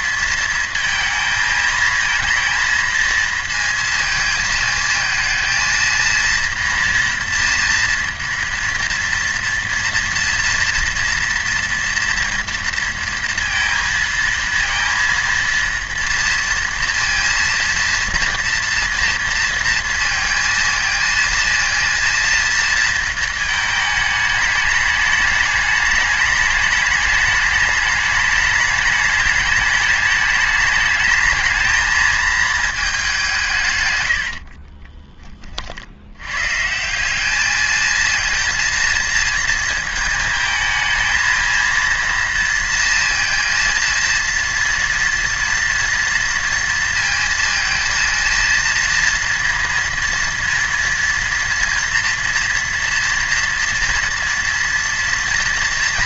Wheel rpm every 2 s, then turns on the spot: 230, 230, 220, 230, 230, 230, 230, 230, 230, 230, 230, 230, 210, 210, 210, 210, 220, 40, 160, 230, 220, 230, 230, 230, 230, 230, 230, 230.
34-36